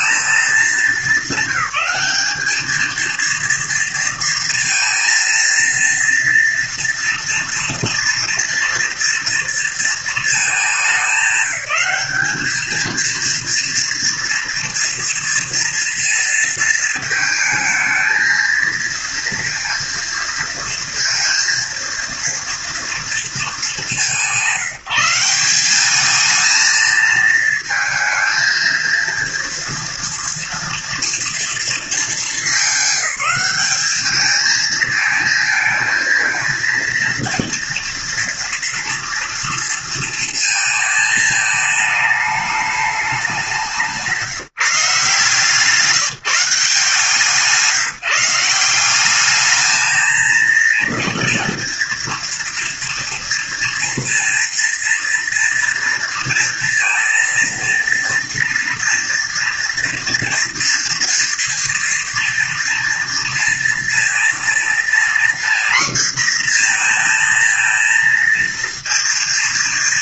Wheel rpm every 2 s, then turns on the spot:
220, 210, 230, 230, 230, 220, 210, 230, 230, 220, 230, 230, 190, 220, 230, 240, 220, 220, 230, 230, 230, 210, 170, 170, 170, 230, 230, 230, 230, 230, 240, 230, 230, 240, 230.
none